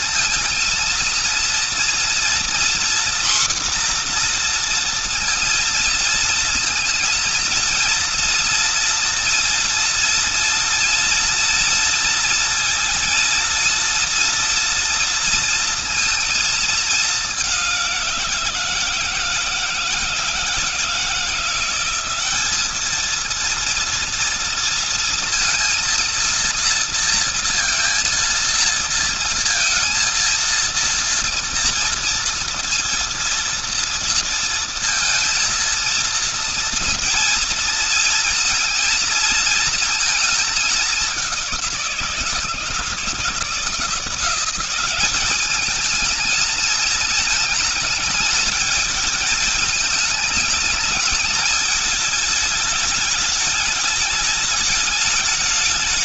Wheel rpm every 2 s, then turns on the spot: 230, 240, 230, 230, 230, 230, 230, 230, 210, 160, 160, 220, 230, 230, 230, 230, 230, 230, 230, 230, 200, 160, 190, 220, 220, 210, 210, 210.
none